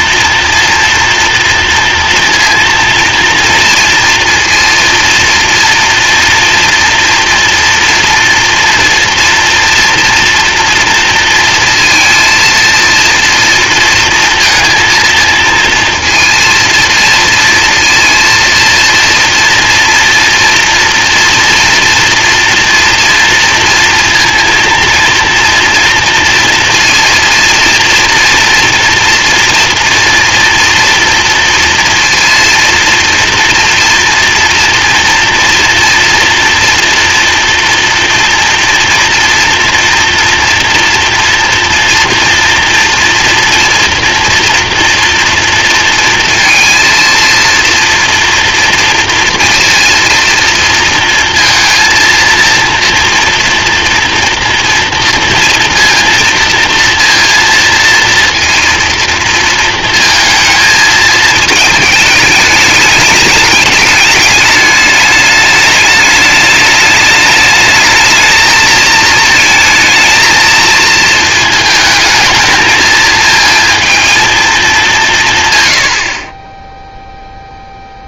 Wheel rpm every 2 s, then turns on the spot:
230, 230, 230, 230, 240, 230, 230, 230, 230, 230, 230, 230, 230, 230, 240, 230, 230, 230, 230, 240, 230, 230, 230, 230, 240, 230, 230, 230, 240, 230, 220, 210, 210, 210, 220, 230, 220, 200, 10.
none